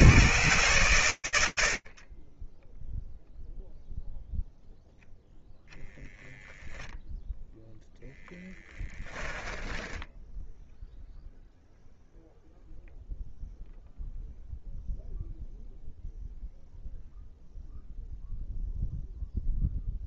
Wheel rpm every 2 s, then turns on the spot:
130, 0, 0, 0, 10, 0, 0, 0, 0, 0.
8-10